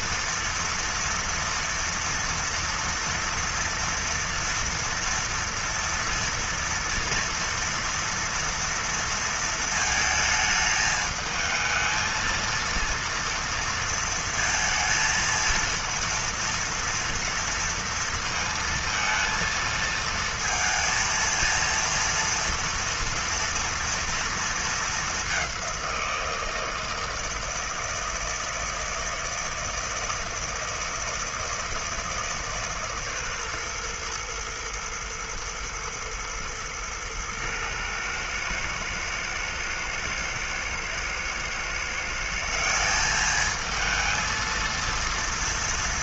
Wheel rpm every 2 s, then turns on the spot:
230, 240, 240, 230, 230, 220, 230, 230, 230, 230, 230, 230, 230, 170, 160, 160, 150, 120, 110, 110, 110, 150, 230.
none